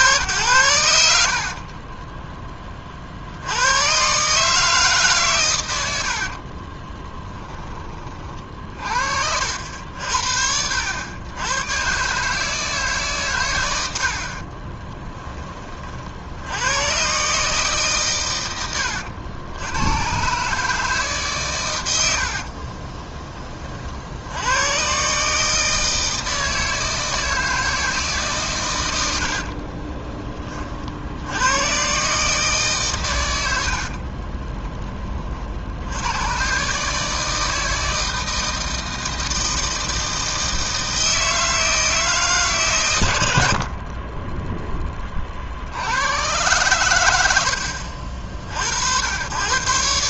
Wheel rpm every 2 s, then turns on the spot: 90, 20, 150, 30, 50, 70, 150, 30, 80, 110, 150, 40, 100, 160, 120, 40, 140, 30, 130, 160, 160, 130, 10, 110, 70.
6-8 14-16 22-24